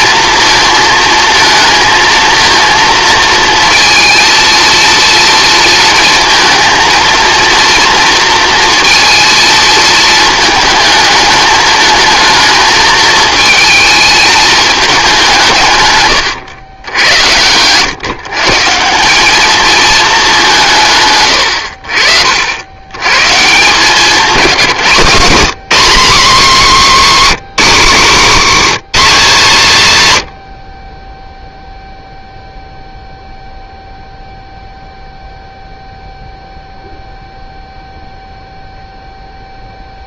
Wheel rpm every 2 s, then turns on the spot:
230, 230, 230, 230, 230, 220, 220, 210, 100, 170, 160, 90, 170, 240, 240, 40, 0, 0, 0, 0.
none